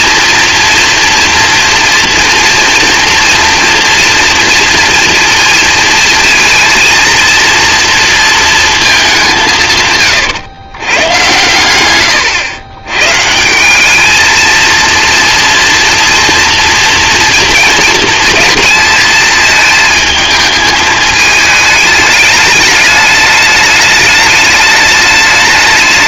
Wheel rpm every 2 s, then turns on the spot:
240, 240, 230, 230, 230, 160, 110, 220, 230, 230, 220, 210, 210.
none